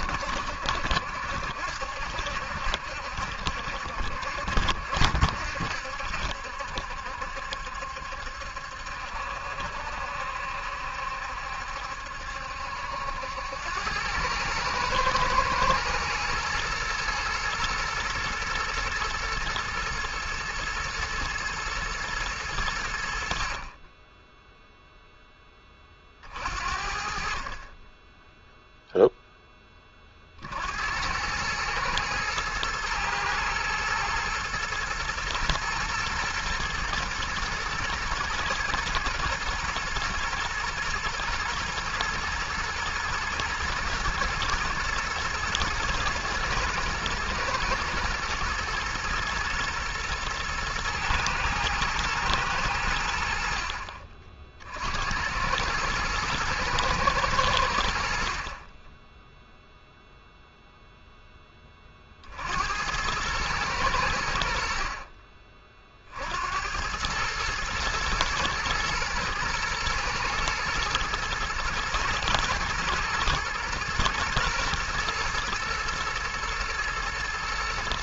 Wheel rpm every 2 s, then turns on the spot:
70, 70, 70, 70, 70, 70, 70, 110, 120, 110, 110, 90, 0, 50, 0, 70, 110, 120, 120, 120, 110, 110, 120, 110, 110, 110, 90, 60, 110, 30, 0, 90, 70, 90, 110, 110, 110, 110, 110.
none